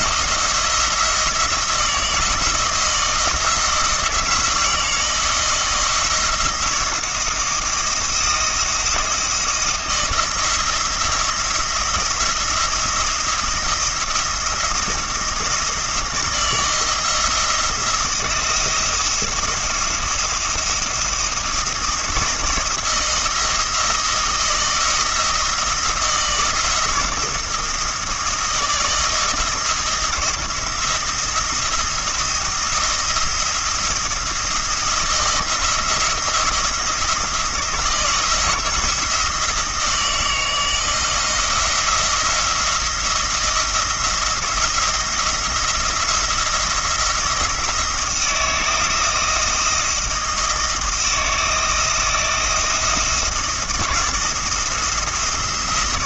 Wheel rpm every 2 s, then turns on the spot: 170, 160, 170, 160, 170, 160, 170, 170, 170, 170, 170, 170, 170, 160, 160, 170, 170, 170, 170, 170, 160, 170, 170, 170, 160, 160, 170, 170.
none